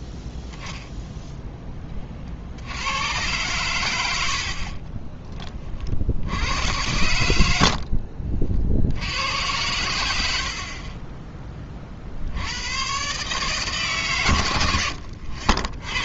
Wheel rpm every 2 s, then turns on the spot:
10, 60, 60, 90, 60, 50, 100, 90.
none